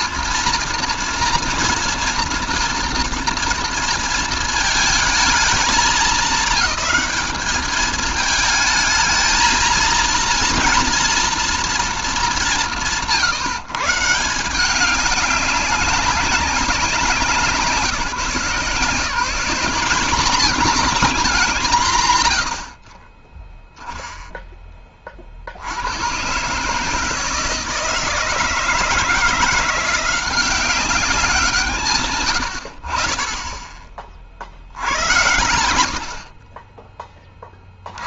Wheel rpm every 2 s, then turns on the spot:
230, 230, 220, 220, 220, 230, 170, 190, 190, 170, 230, 60, 10, 140, 160, 190, 70, 80, 40.
22-24